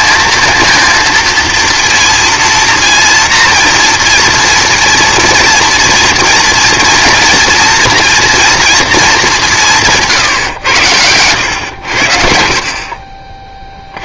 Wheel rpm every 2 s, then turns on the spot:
220, 230, 230, 230, 230, 100, 50.
none